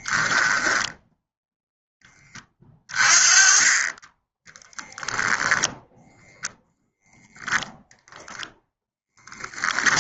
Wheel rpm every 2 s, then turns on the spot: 10, 20, 0, 0, 10.
0-2